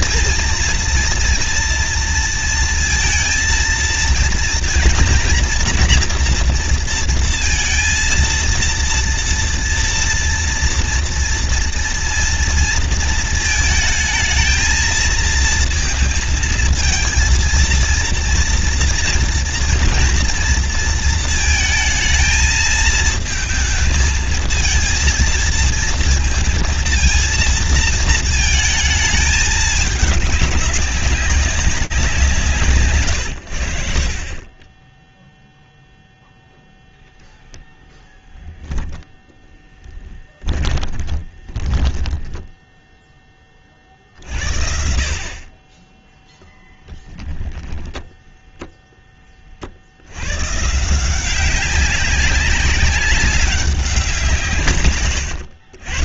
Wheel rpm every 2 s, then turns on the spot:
230, 230, 230, 230, 230, 230, 230, 220, 230, 230, 230, 220, 220, 230, 220, 200, 150, 20, 0, 0, 20, 10, 40, 0, 0, 160, 190, 130.
40-42